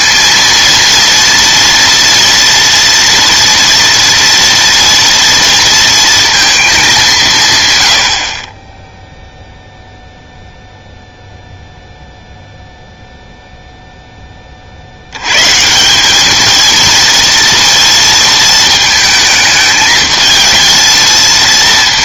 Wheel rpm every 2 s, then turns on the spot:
230, 230, 240, 220, 30, 0, 0, 40, 220, 220, 220.
none